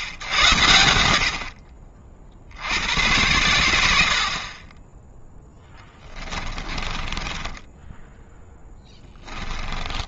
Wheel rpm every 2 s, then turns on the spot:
100, 70, 40, 20, 10.
6-10